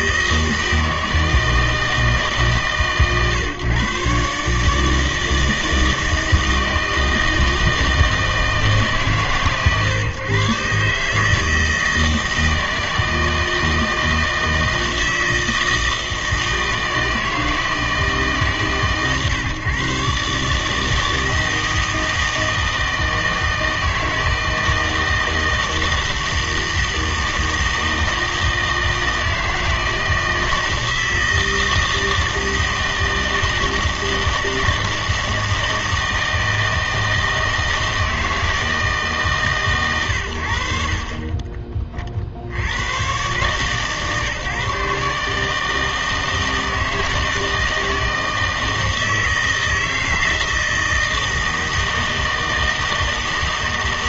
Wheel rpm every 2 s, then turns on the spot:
160, 140, 150, 160, 160, 140, 160, 160, 160, 150, 150, 160, 160, 160, 160, 160, 160, 160, 160, 160, 70, 90, 140, 160, 160, 160, 160.
none